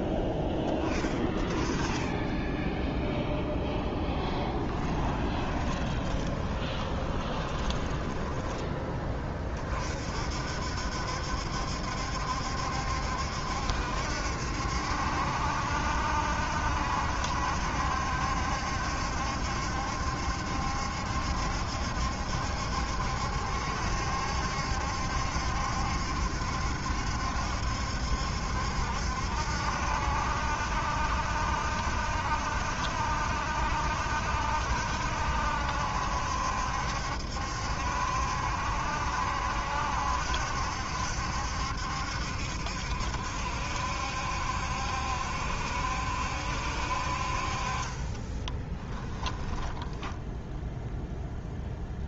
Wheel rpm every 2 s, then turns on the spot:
10, 0, 10, 20, 20, 60, 70, 70, 70, 70, 70, 70, 70, 70, 70, 70, 70, 70, 70, 70, 70, 70, 70, 60, 20, 0.
4-8 48-50